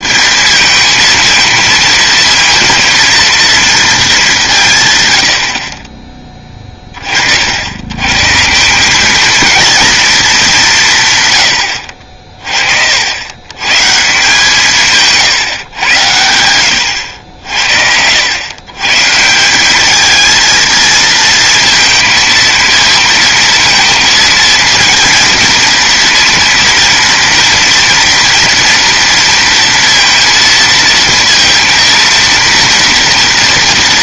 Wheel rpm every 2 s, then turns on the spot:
210, 230, 160, 20, 170, 180, 50, 160, 90, 110, 220, 230, 220, 230, 230, 230, 230.
none